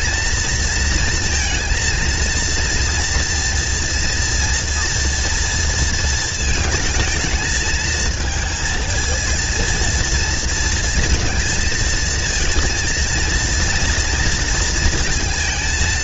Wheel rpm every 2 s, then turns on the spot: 230, 230, 230, 220, 220, 230, 230, 230.
none